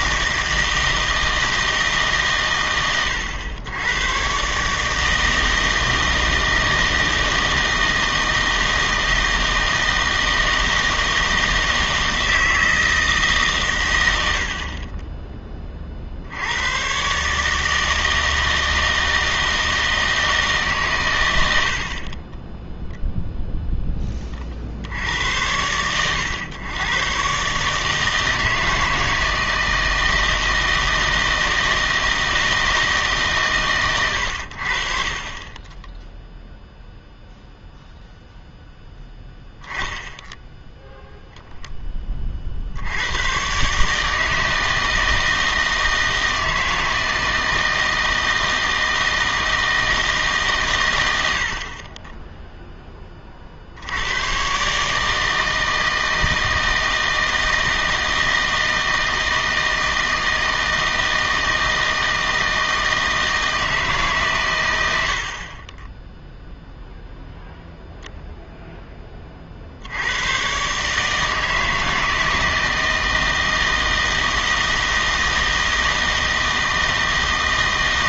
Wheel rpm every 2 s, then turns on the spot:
160, 110, 150, 160, 160, 160, 160, 40, 100, 160, 140, 0, 20, 110, 160, 160, 160, 60, 0, 0, 0, 60, 160, 160, 160, 120, 10, 140, 160, 160, 160, 160, 110, 0, 0, 130, 160, 160, 160.
none